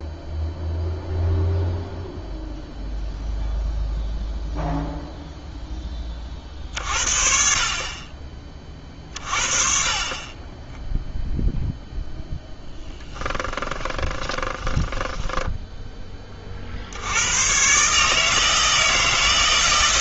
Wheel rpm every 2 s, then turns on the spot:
0, 0, 0, 50, 30, 10, 0, 10, 70, 160.
14-16